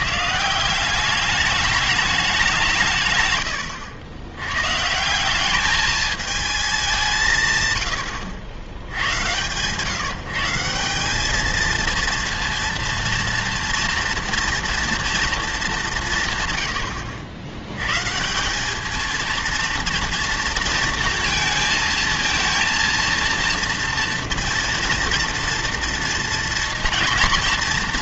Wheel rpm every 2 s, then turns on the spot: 170, 170, 120, 210, 90, 170, 230, 230, 120, 200, 230, 230, 230, 230.
none